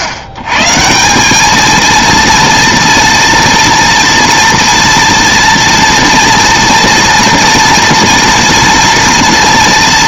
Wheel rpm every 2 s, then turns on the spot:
130, 230, 230, 230, 230.
none